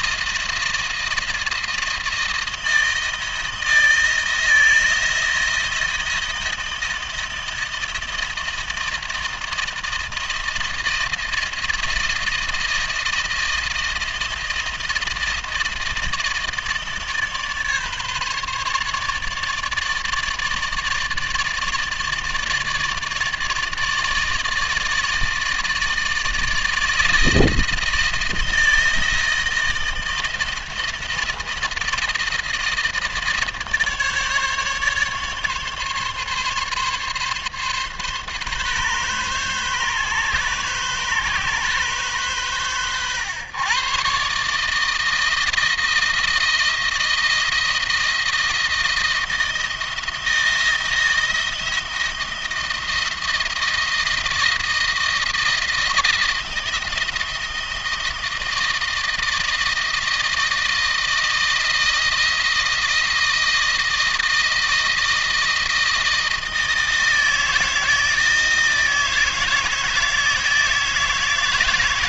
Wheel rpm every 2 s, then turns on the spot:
160, 160, 160, 170, 160, 160, 160, 160, 160, 150, 160, 150, 160, 160, 160, 170, 160, 150, 140, 140, 140, 120, 160, 160, 170, 170, 170, 170, 170, 160, 160, 160, 160, 160, 160, 160.
none